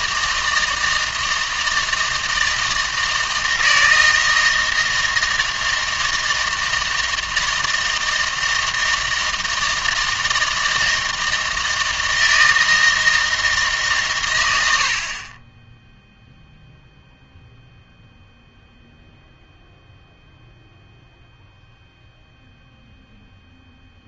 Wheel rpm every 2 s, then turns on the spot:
160, 160, 160, 160, 160, 160, 160, 70, 0, 0, 0, 0.
none